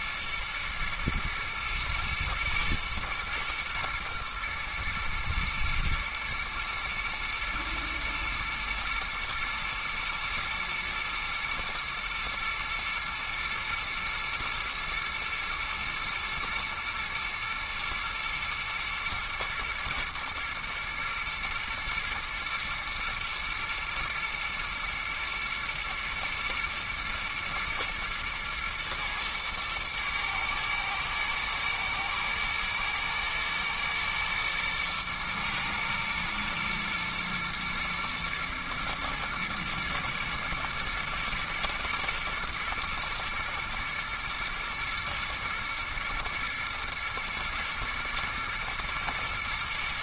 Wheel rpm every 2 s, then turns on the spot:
120, 110, 120, 120, 120, 120, 110, 120, 120, 110, 120, 120, 120, 110, 110, 110, 110, 120, 120, 110, 110, 110, 110, 120, 110.
none